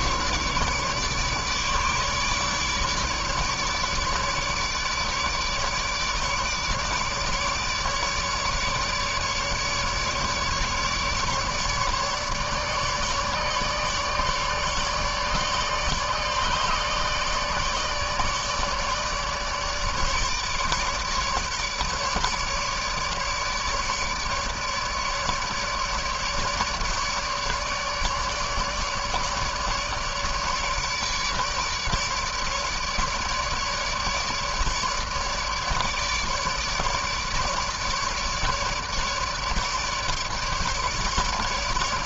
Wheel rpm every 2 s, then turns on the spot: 150, 150, 150, 150, 150, 150, 150, 150, 150, 150, 150, 150, 150, 150, 150, 150, 160, 150, 150, 150, 150.
none